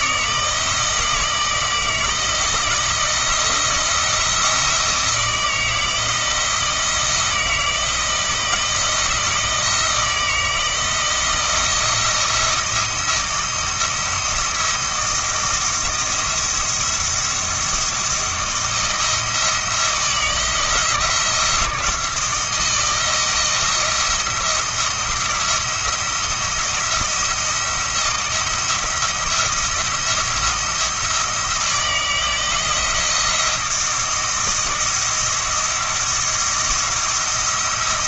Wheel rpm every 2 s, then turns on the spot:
160, 160, 170, 170, 170, 160, 170, 160, 170, 170, 160, 160, 170, 170, 160, 170, 170, 170, 170.
none